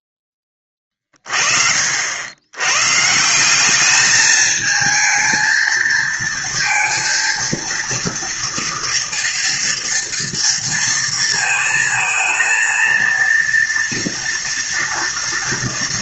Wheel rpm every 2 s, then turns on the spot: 20, 110, 220, 230, 230, 230, 220, 230.
none